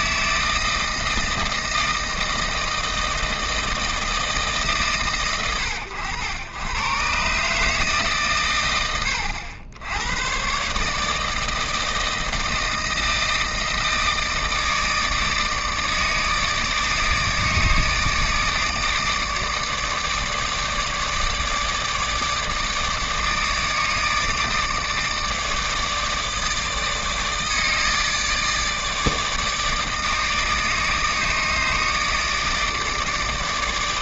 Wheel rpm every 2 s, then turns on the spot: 160, 160, 140, 110, 100, 140, 160, 160, 160, 160, 150, 160, 160, 160, 160, 150, 150.
none